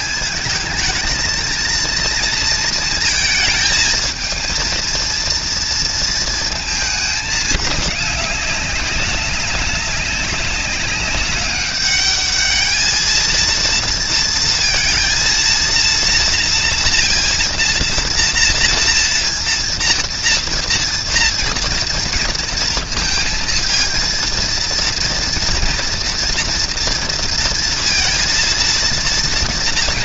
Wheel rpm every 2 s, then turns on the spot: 230, 230, 230, 210, 200, 200, 220, 230, 230, 230, 230, 230, 230, 230, 240.
none